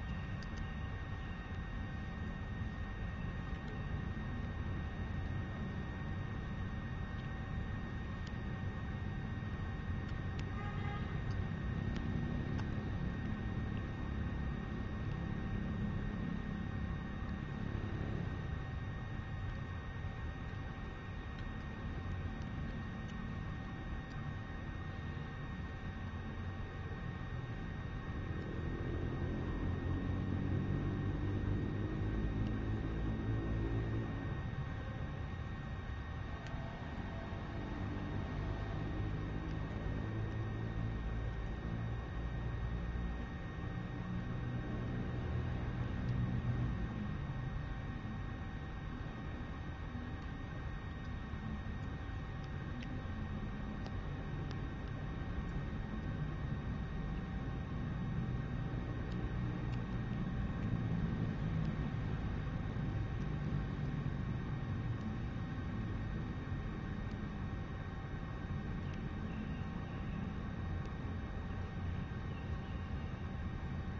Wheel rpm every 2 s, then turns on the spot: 0, 0, 0, 0, 0, 0, 0, 0, 0, 0, 0, 0, 0, 0, 0, 0, 0, 0, 0, 0, 0, 0, 0, 0, 0, 0, 0, 0, 0, 0, 0, 0, 0, 0, 0, 0, 0.
none